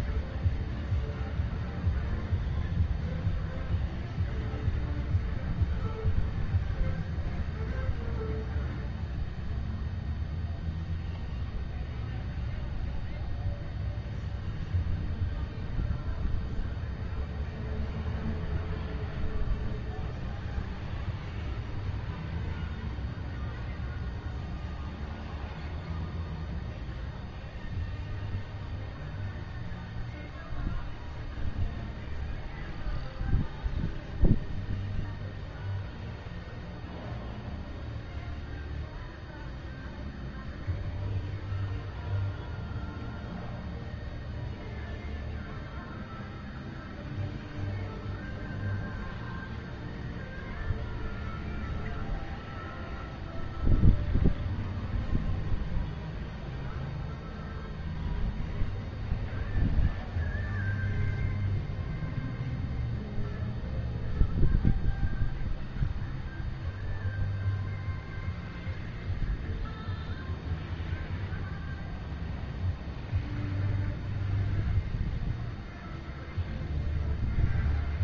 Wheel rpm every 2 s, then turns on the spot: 0, 0, 0, 0, 0, 0, 0, 0, 0, 0, 0, 0, 0, 0, 0, 0, 0, 0, 0, 0, 0, 0, 0, 0, 0, 0, 0, 0, 0, 0, 0, 0, 0, 0, 0, 0, 0, 0, 0.
none